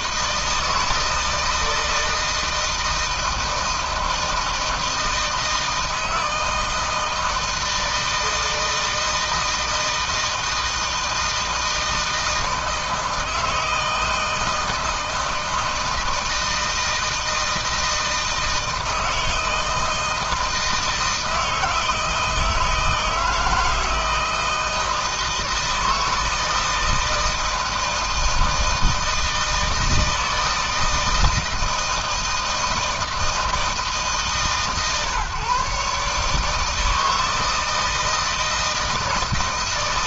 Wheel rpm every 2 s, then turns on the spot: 160, 160, 160, 160, 160, 160, 160, 160, 160, 160, 160, 160, 160, 160, 160, 160, 160, 140, 160, 160.
none